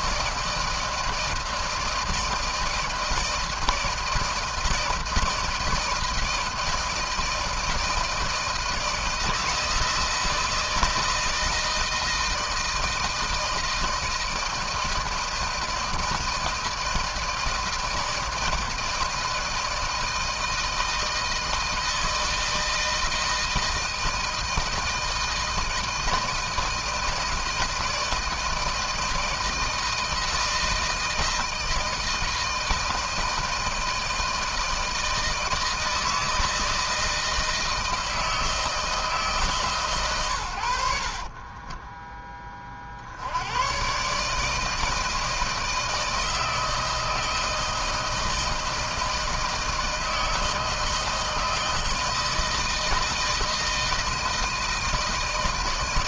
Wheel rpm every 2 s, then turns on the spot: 160, 160, 160, 160, 160, 160, 160, 160, 160, 160, 160, 160, 160, 160, 170, 160, 160, 160, 160, 160, 90, 30, 150, 160, 160, 160, 160, 160.
none